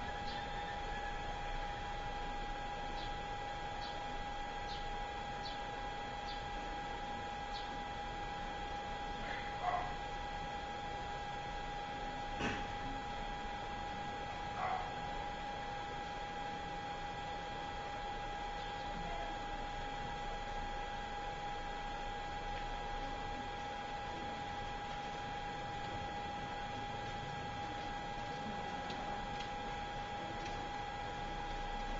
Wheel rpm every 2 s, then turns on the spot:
0, 0, 0, 0, 0, 0, 0, 0, 0, 0, 0, 0, 0, 0, 0, 0.
none